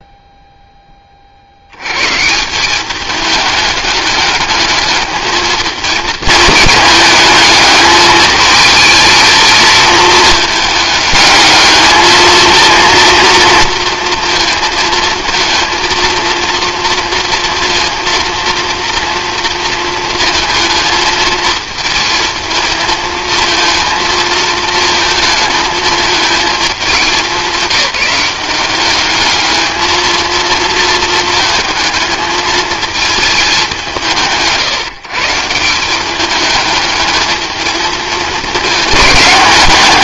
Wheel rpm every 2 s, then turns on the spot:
10, 190, 210, 220, 220, 210, 230, 230, 230, 230, 220, 230, 220, 210, 200, 230, 220, 150, 210, 220.
none